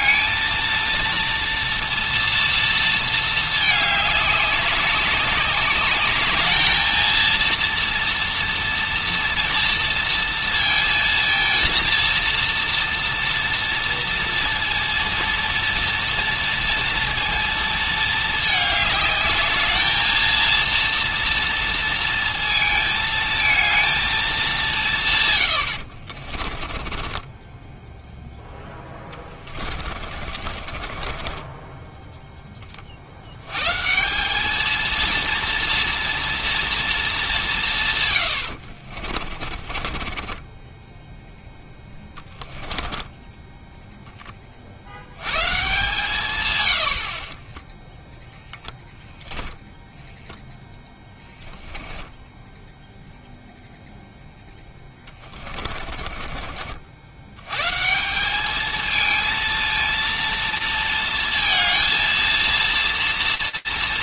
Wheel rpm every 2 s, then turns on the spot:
230, 230, 200, 220, 230, 230, 230, 230, 230, 210, 230, 220, 180, 20, 10, 30, 20, 220, 230, 70, 10, 10, 60, 100, 10, 10, 10, 10, 50, 210, 230, 230.
26-32 38-44 50-52 54-56